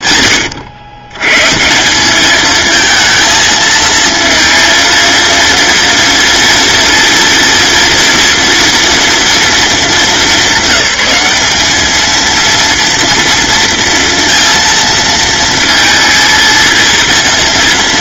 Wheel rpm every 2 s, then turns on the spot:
110, 220, 230, 230, 230, 200, 230, 230, 230.
none